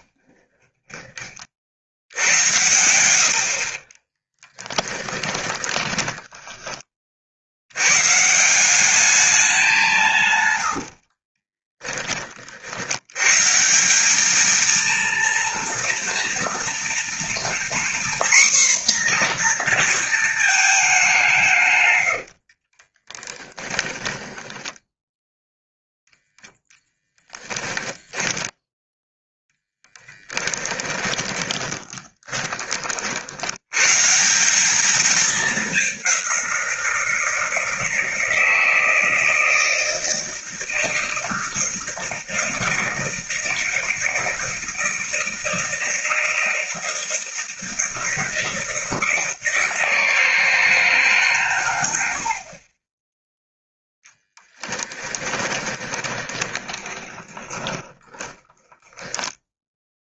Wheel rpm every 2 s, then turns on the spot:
20, 100, 10, 30, 200, 70, 80, 230, 240, 250, 200, 30, 20, 10, 0, 20, 50, 210, 170, 160, 160, 160, 160, 160, 160, 150, 20, 10, 20, 10.
0-6 10-12 22-28 30-32 54-60